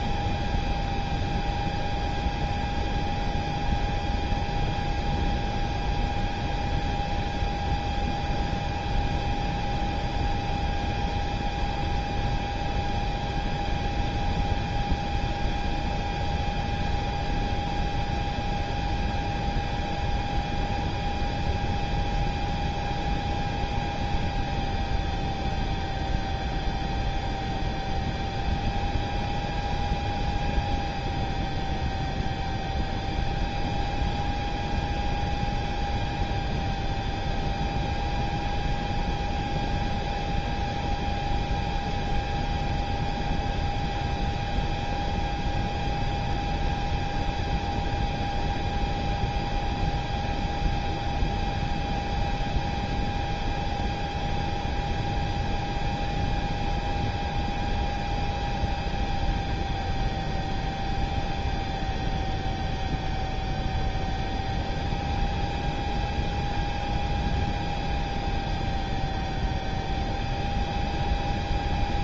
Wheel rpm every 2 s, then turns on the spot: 0, 0, 0, 0, 0, 0, 0, 0, 0, 0, 0, 0, 0, 0, 0, 0, 0, 0, 0, 0, 0, 0, 0, 0, 0, 0, 0, 0, 0, 0, 0, 0, 0, 0, 0, 0.
none